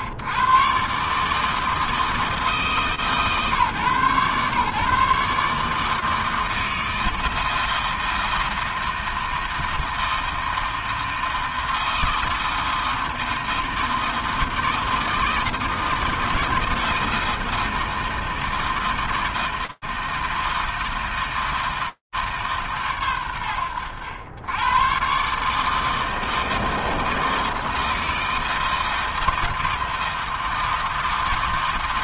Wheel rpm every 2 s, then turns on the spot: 100, 160, 130, 160, 160, 160, 160, 160, 160, 160, 160, 100, 120, 160, 160, 160.
none